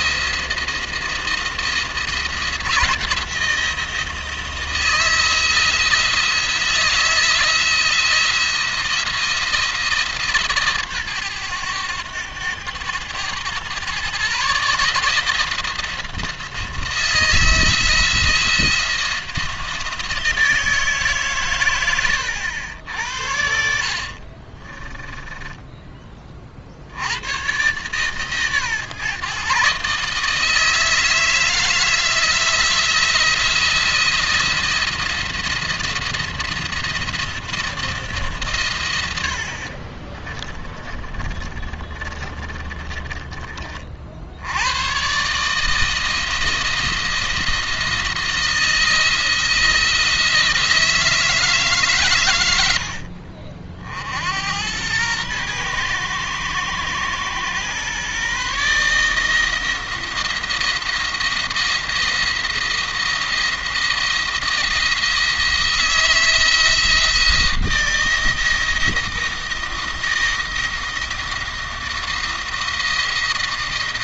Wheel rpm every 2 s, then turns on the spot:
170, 170, 170, 160, 170, 150, 100, 140, 160, 170, 160, 90, 30, 60, 140, 160, 170, 170, 170, 130, 30, 30, 90, 170, 170, 160, 90, 90, 120, 150, 170, 170, 170, 170, 160, 170, 160.
24-26 40-44